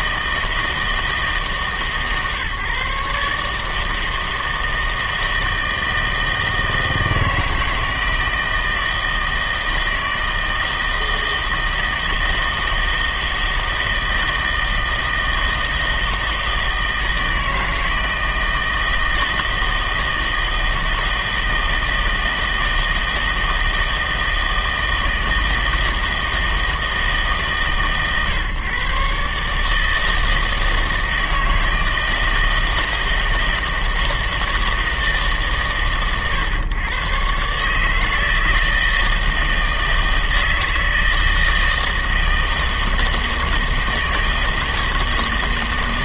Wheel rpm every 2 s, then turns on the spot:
160, 140, 160, 160, 160, 160, 160, 160, 160, 160, 160, 160, 160, 160, 130, 160, 160, 160, 120, 160, 160, 160, 160.
none